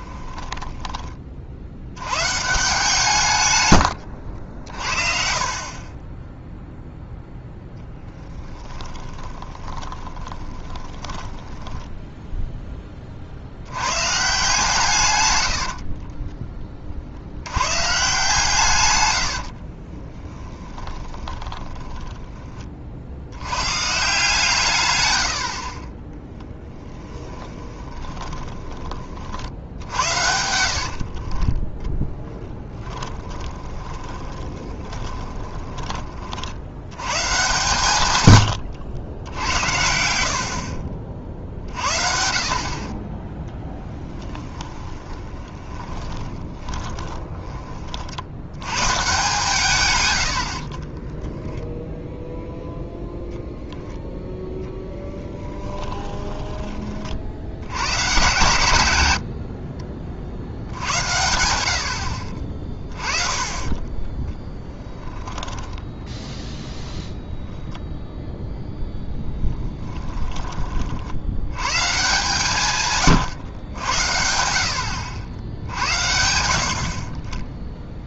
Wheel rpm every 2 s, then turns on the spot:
10, 150, 50, 0, 10, 20, 10, 150, 30, 140, 10, 30, 140, 30, 30, 60, 10, 30, 80, 110, 50, 40, 20, 20, 110, 40, 0, 10, 20, 130, 60, 30, 10, 0, 10, 50, 140, 60, 50.
0-2 8-12 20-22 26-28 30-36 38-40 44-48 50-52 62-66 68-70